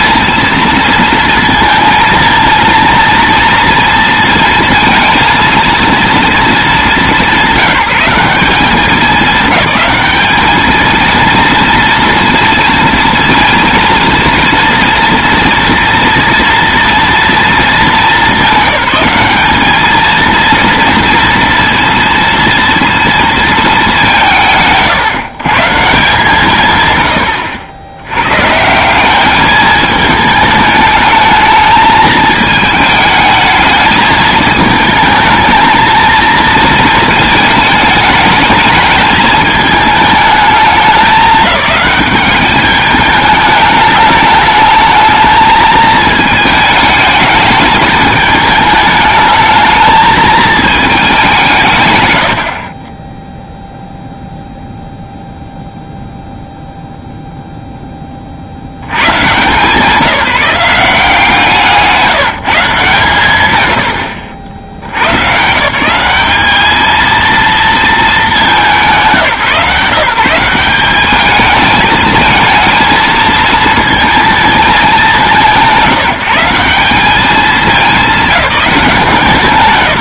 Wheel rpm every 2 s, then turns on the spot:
230, 230, 230, 200, 200, 220, 230, 230, 230, 200, 230, 230, 150, 120, 190, 210, 220, 220, 220, 220, 210, 210, 210, 210, 210, 220, 20, 0, 0, 120, 170, 120, 80, 220, 170, 200, 230, 190, 190, 180.
none